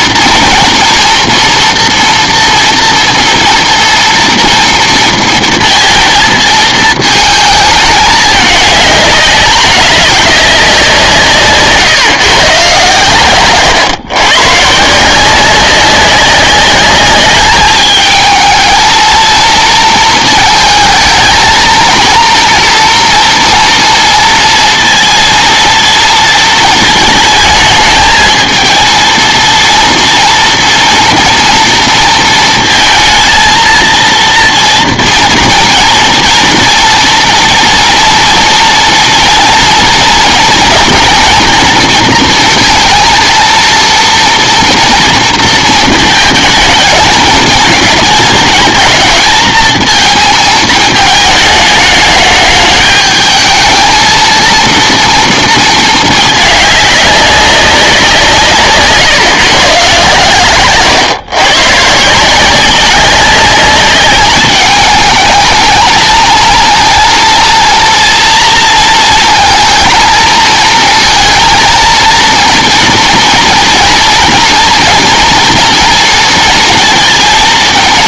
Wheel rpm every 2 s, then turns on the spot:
230, 230, 230, 220, 210, 190, 130, 140, 200, 220, 220, 230, 230, 220, 230, 230, 230, 240, 230, 230, 230, 230, 230, 220, 220, 220, 210, 230, 210, 140, 140, 180, 200, 230, 230, 220, 230, 230, 230.
none